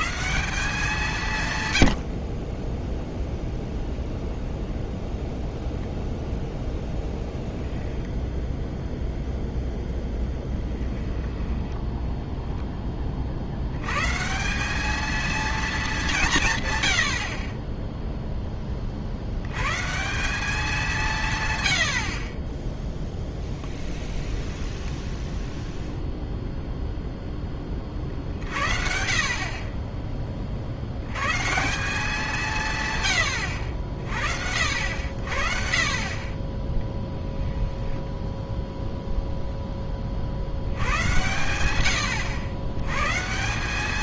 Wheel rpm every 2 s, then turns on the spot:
170, 20, 0, 0, 0, 20, 10, 200, 130, 30, 200, 10, 10, 0, 50, 60, 140, 60, 10, 0, 90, 110.
10-12 24-26